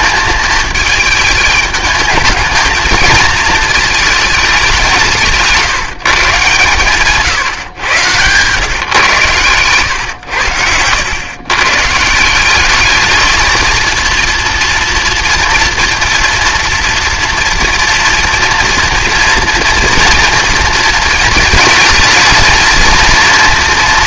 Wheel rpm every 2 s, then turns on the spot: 210, 220, 190, 140, 130, 100, 210, 230, 230, 230, 230, 220.
none